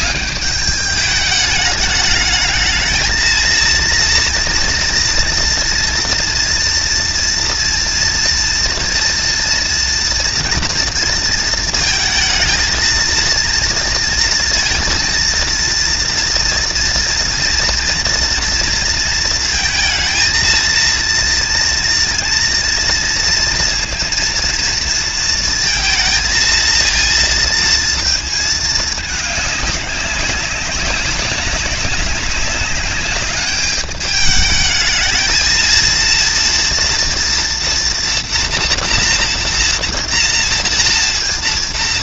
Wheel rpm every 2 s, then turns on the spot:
210, 220, 240, 240, 230, 230, 230, 230, 230, 230, 230, 230, 230, 230, 210, 200, 200, 220, 230, 230, 230.
none